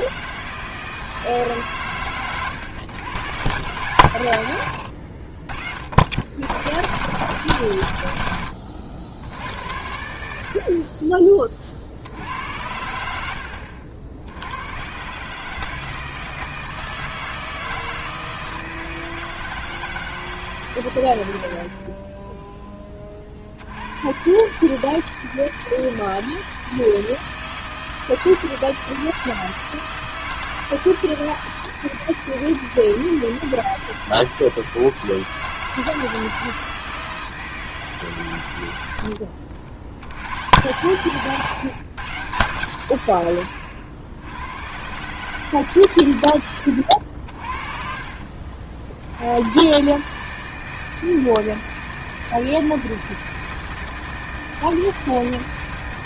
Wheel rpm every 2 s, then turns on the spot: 160, 110, 100, 100, 90, 50, 80, 100, 160, 160, 140, 10, 150, 160, 160, 160, 160, 160, 160, 100, 100, 120, 110, 100, 60, 160, 160, 160.
4-6